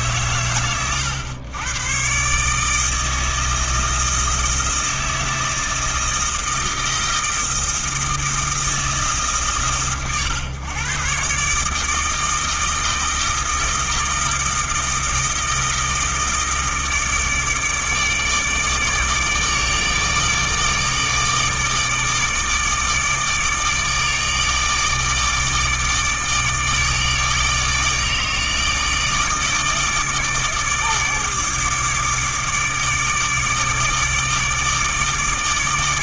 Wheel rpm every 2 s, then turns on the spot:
110, 160, 160, 160, 160, 130, 160, 160, 160, 150, 160, 160, 150, 150, 150, 150, 150, 150.
none